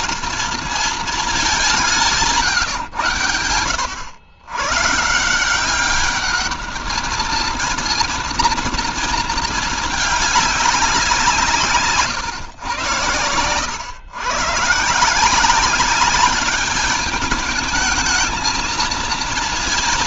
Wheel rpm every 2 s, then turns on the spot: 220, 130, 130, 210, 230, 200, 110, 150, 200, 230.
none